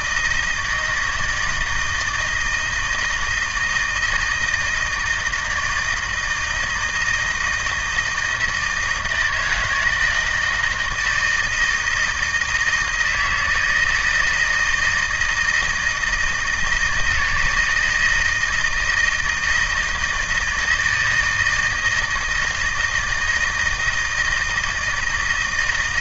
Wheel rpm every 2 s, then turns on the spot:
160, 160, 160, 160, 160, 160, 160, 160, 160, 160, 160, 160, 170.
none